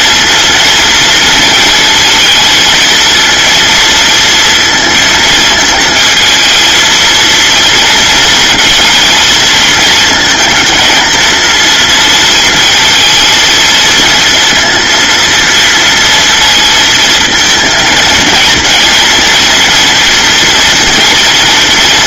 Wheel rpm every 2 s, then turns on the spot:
230, 230, 230, 230, 230, 220, 220, 230, 230, 230, 240.
none